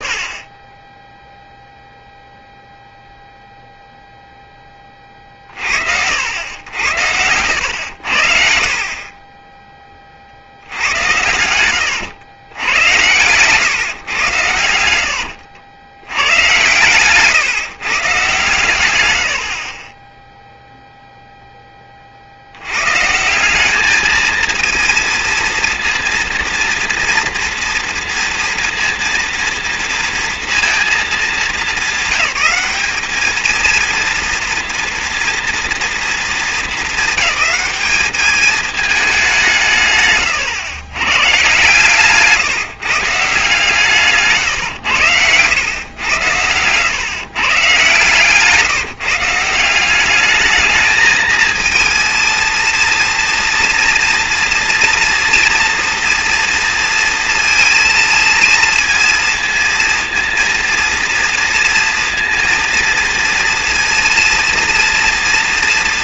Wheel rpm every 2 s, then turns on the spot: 0, 0, 20, 80, 50, 80, 100, 100, 120, 110, 0, 100, 230, 230, 230, 220, 200, 230, 220, 220, 120, 170, 120, 110, 170, 220, 230, 240, 230, 230, 230, 230, 230.
14-16